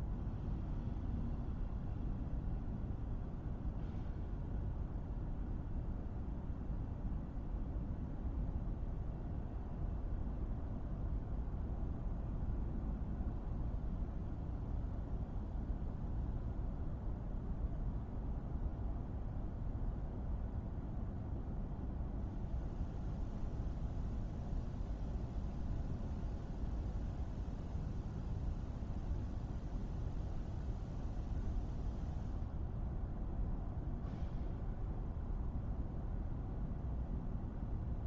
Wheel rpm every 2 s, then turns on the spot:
0, 0, 0, 0, 0, 0, 0, 0, 0, 0, 0, 0, 0, 0, 0, 0, 0, 0, 0.
none